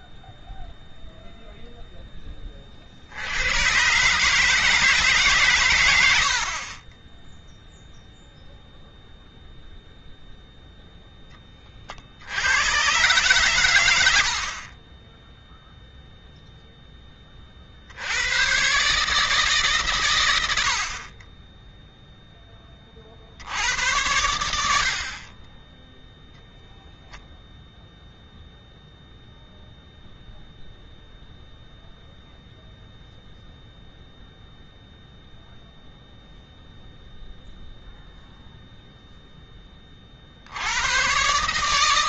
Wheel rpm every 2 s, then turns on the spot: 0, 40, 150, 50, 0, 0, 110, 50, 0, 120, 70, 20, 80, 0, 0, 0, 0, 0, 0, 0, 90.
14-16